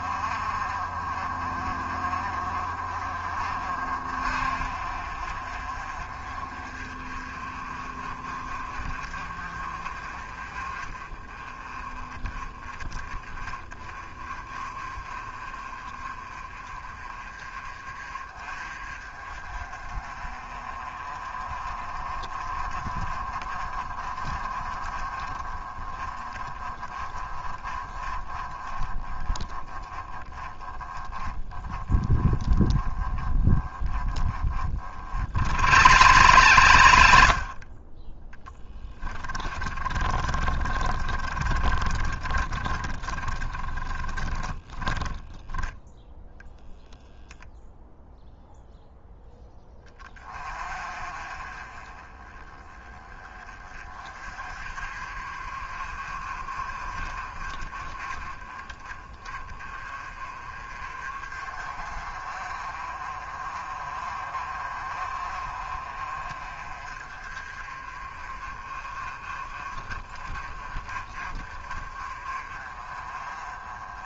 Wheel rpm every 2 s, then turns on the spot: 40, 40, 40, 40, 40, 30, 30, 30, 30, 30, 30, 30, 30, 30, 20, 20, 20, 40, 70, 20, 30, 20, 10, 0, 0, 30, 20, 40, 30, 30, 40, 40, 40, 30, 30, 40, 30.
38-46